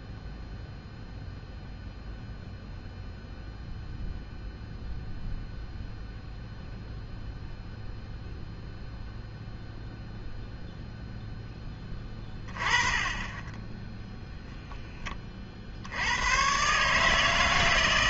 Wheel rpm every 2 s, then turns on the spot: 0, 0, 0, 0, 0, 0, 20, 0, 130.
none